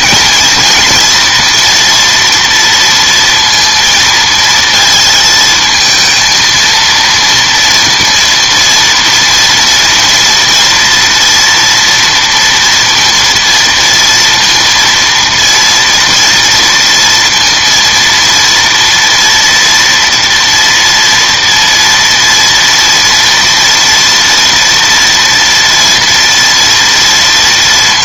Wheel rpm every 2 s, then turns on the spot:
230, 230, 230, 230, 230, 230, 230, 230, 230, 230, 230, 230, 230, 230.
none